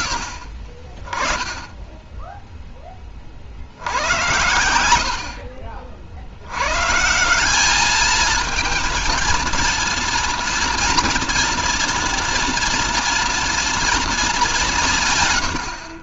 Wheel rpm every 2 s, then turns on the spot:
30, 50, 70, 160, 230, 240, 240, 140.
none